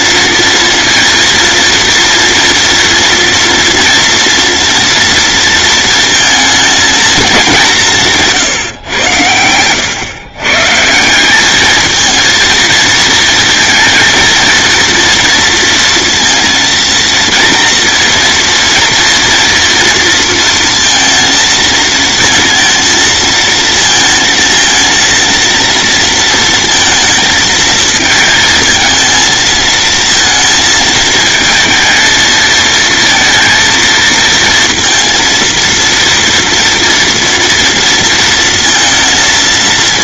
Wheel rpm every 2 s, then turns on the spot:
230, 240, 230, 220, 110, 170, 230, 230, 230, 230, 230, 230, 230, 220, 220, 220, 230, 230, 230, 230.
none